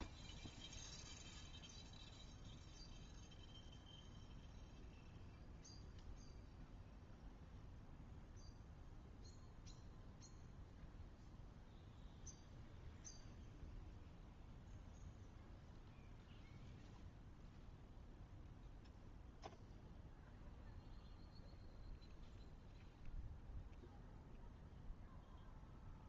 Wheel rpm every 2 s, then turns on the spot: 0, 0, 0, 0, 0, 0, 0, 0, 0, 0, 0, 0, 0.
none